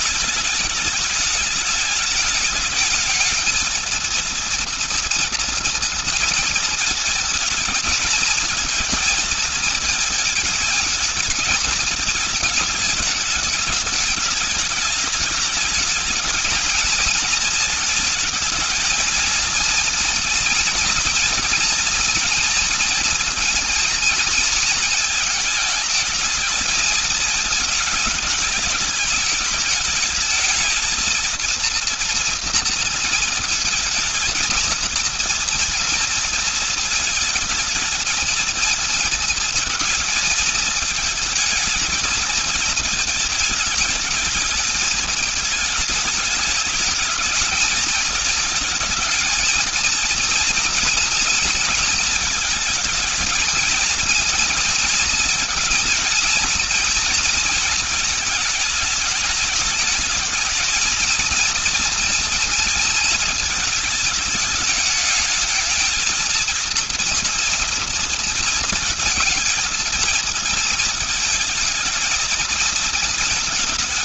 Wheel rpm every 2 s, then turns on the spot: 210, 220, 230, 230, 220, 220, 210, 210, 220, 220, 240, 240, 220, 220, 210, 220, 230, 230, 230, 230, 220, 220, 210, 210, 220, 230, 220, 230, 230, 220, 220, 230, 210, 230, 230, 220, 230.
none